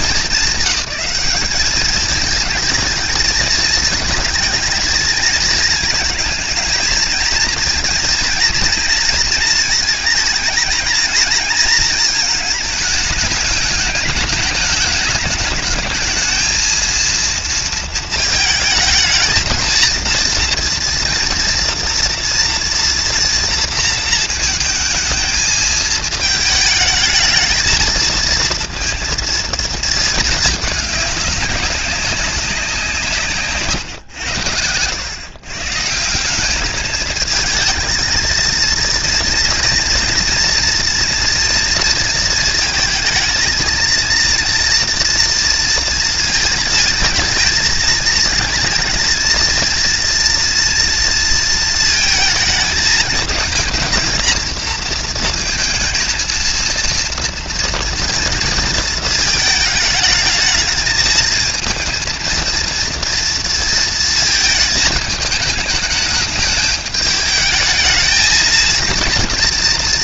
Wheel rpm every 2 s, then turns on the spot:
200, 220, 220, 230, 230, 230, 220, 210, 230, 220, 230, 230, 220, 220, 230, 200, 160, 120, 220, 230, 240, 220, 230, 220, 230, 230, 220, 230, 230, 230, 220, 230, 210, 210, 230.
none